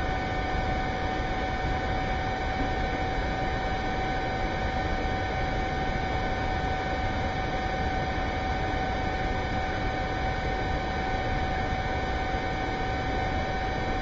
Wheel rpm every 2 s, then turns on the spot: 0, 0, 0, 0, 0, 0, 0.
none